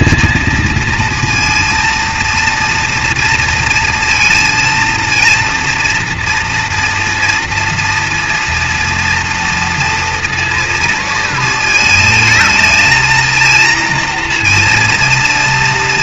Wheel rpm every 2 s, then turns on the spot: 230, 230, 230, 230, 230, 230, 220, 230.
none